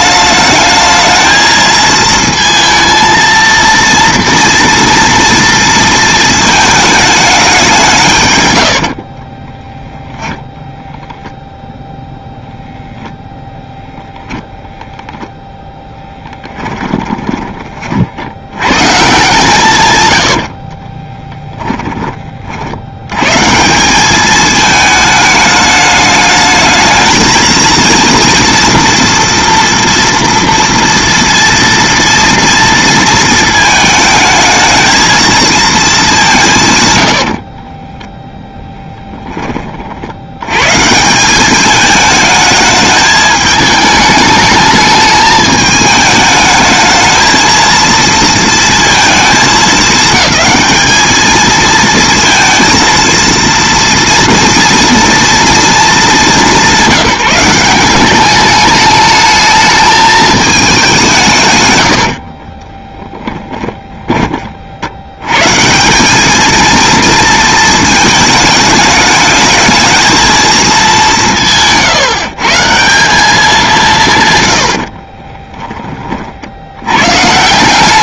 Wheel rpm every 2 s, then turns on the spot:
220, 230, 230, 220, 70, 0, 0, 0, 10, 110, 50, 70, 220, 220, 240, 230, 230, 220, 140, 10, 130, 210, 210, 220, 230, 210, 230, 230, 190, 210, 210, 30, 50, 230, 210, 210, 170, 80, 90.
8-10 16-18 20-22 36-40 62-64